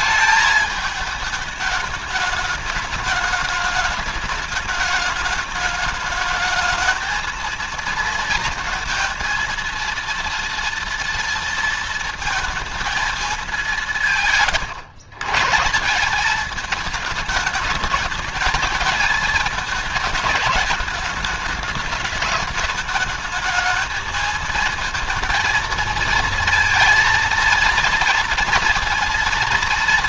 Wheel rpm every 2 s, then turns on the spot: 220, 210, 210, 220, 230, 230, 220, 130, 210, 210, 210, 210, 230, 230, 230.
none